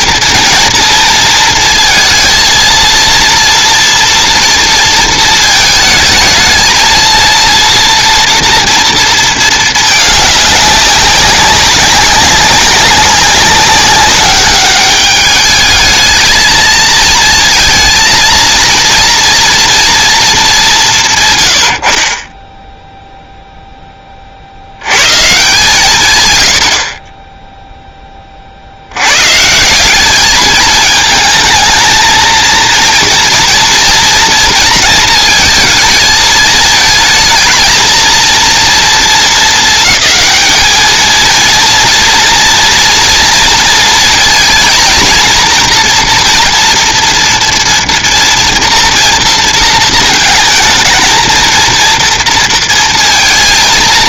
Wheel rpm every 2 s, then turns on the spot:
230, 230, 230, 220, 230, 200, 200, 200, 220, 230, 210, 10, 70, 90, 40, 210, 230, 230, 220, 230, 220, 230, 230, 230, 230, 220, 230.
none